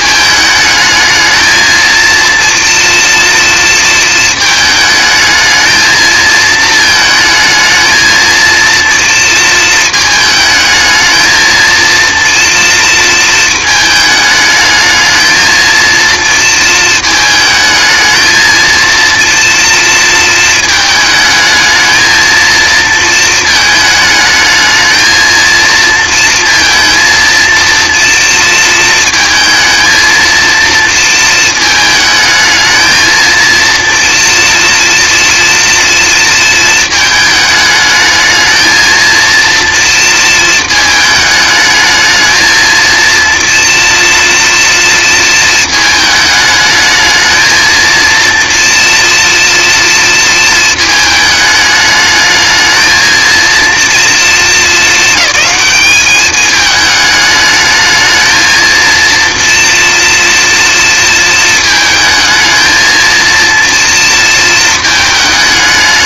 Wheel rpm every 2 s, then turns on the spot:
220, 240, 220, 220, 230, 220, 220, 220, 220, 230, 230, 230, 220, 230, 230, 230, 220, 240, 230, 220, 220, 230, 230, 220, 230, 220, 220, 220, 210, 230, 230, 220, 220.
none